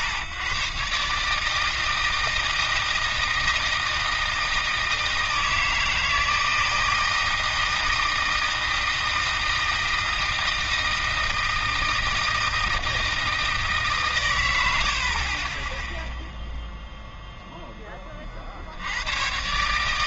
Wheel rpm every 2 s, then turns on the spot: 100, 160, 160, 160, 160, 160, 160, 80, 0, 70.
none